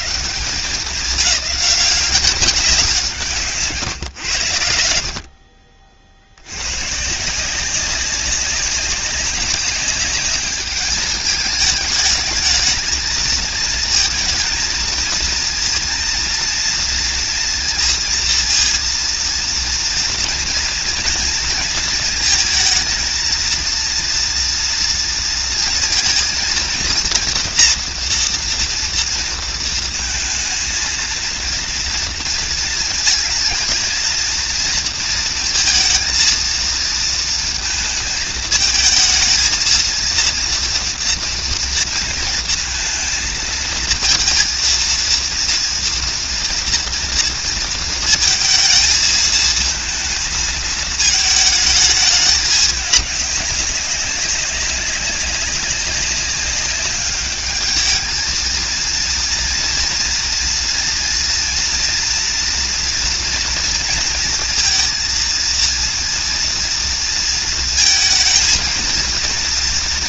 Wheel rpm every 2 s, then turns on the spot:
160, 190, 90, 90, 190, 210, 220, 230, 230, 230, 230, 220, 230, 230, 230, 230, 230, 230, 230, 220, 230, 230, 230, 230, 220, 220, 210, 190, 200, 220, 230, 230, 230, 230, 230.
none